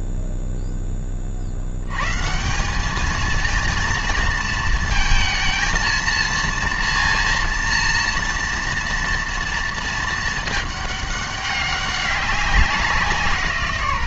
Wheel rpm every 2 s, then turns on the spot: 10, 190, 230, 230, 240, 210, 190.
none